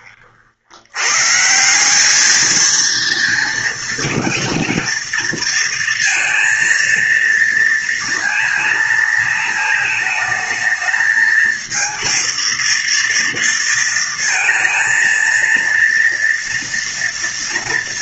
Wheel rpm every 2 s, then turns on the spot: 90, 230, 230, 230, 230, 220, 230, 230, 230.
none